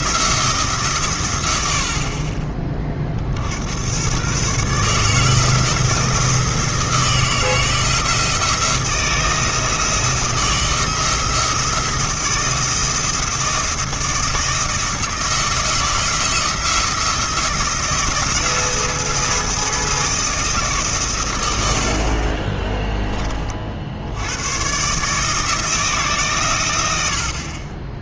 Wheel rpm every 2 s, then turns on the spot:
140, 30, 150, 160, 170, 170, 170, 160, 160, 170, 140, 10, 130, 100.
none